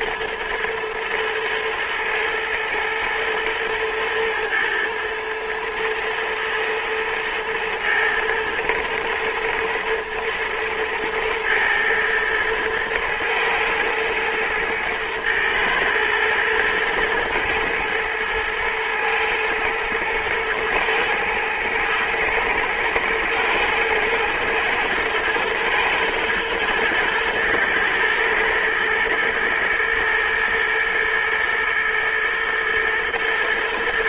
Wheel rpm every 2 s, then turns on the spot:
120, 110, 110, 120, 110, 120, 120, 110, 110, 120, 120, 110, 110, 120, 110, 110, 110.
none